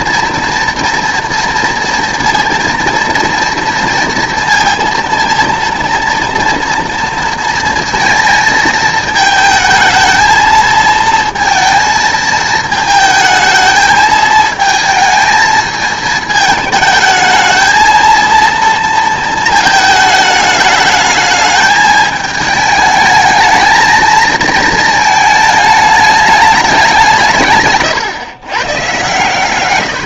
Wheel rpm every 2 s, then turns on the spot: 230, 230, 230, 230, 220, 220, 220, 220, 220, 230, 210, 220, 220, 190, 120.
none